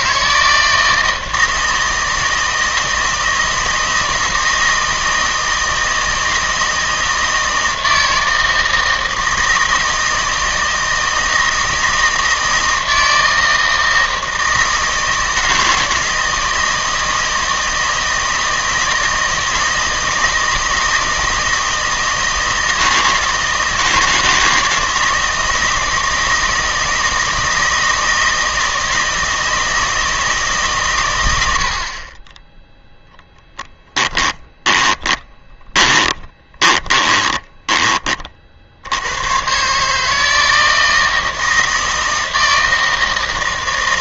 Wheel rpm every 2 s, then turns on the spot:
160, 160, 160, 160, 160, 160, 160, 160, 160, 160, 160, 160, 160, 160, 160, 140, 10, 20, 20, 60, 160, 160.
34-38